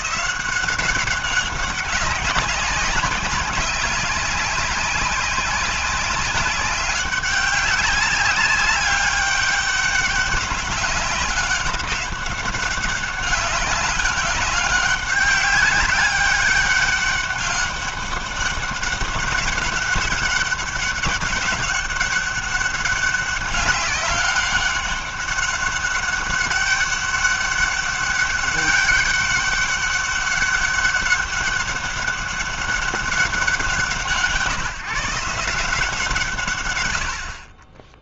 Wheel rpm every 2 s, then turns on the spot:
190, 190, 190, 190, 200, 200, 200, 200, 200, 190, 200, 200, 200, 200, 200, 200, 190, 150, 90.
none